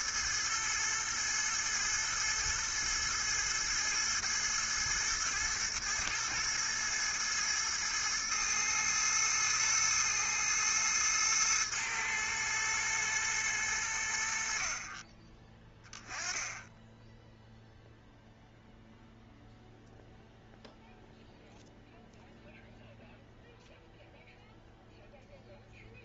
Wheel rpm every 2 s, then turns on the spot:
110, 110, 110, 110, 110, 110, 110, 50, 10, 0, 0, 0, 0.
none